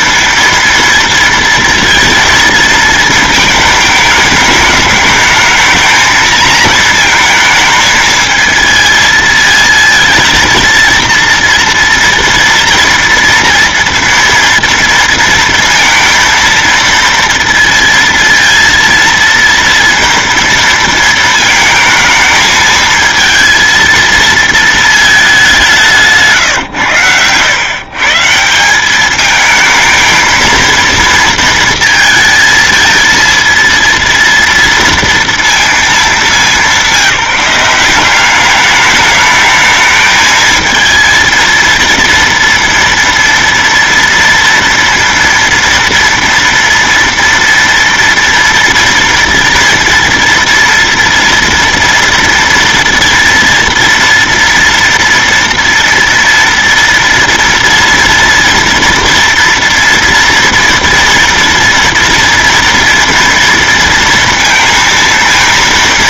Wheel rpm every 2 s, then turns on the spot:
230, 230, 220, 220, 220, 230, 240, 230, 230, 230, 230, 220, 230, 150, 150, 220, 230, 230, 200, 190, 220, 230, 230, 230, 230, 230, 240, 240, 230, 230, 230, 230, 230.
26-28